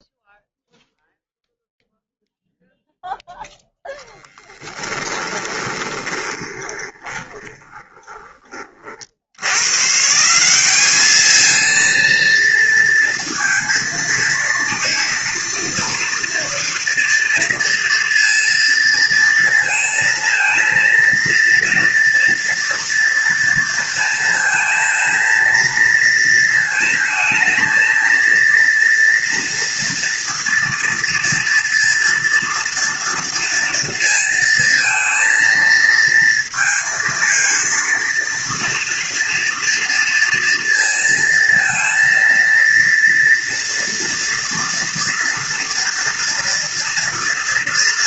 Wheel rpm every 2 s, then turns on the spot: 0, 0, 10, 20, 30, 190, 230, 230, 230, 230, 230, 230, 220, 220, 230, 230, 230, 230, 230, 230, 230, 230, 230, 230.
4-8